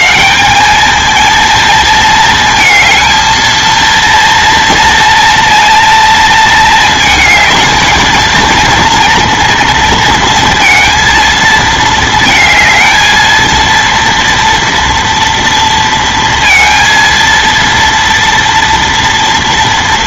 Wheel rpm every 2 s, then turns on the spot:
210, 230, 230, 220, 230, 230, 220, 240, 230, 230.
none